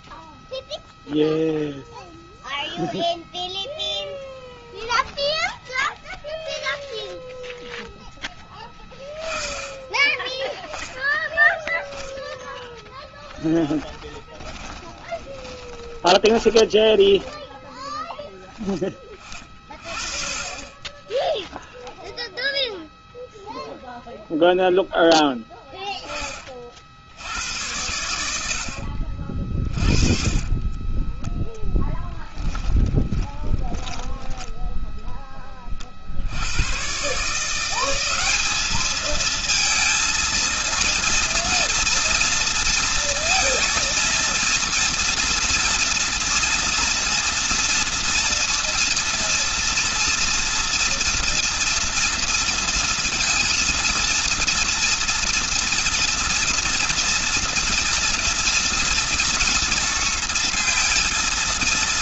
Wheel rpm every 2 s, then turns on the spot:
0, 0, 10, 0, 20, 20, 10, 20, 10, 20, 20, 0, 0, 30, 80, 30, 20, 10, 80, 200, 230, 230, 230, 230, 230, 230, 230, 230, 230, 230, 230.
14-18 32-34